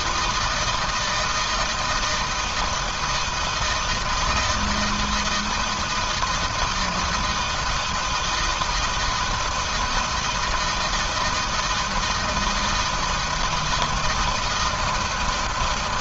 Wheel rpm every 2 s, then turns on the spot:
170, 160, 160, 160, 160, 160, 160, 160.
none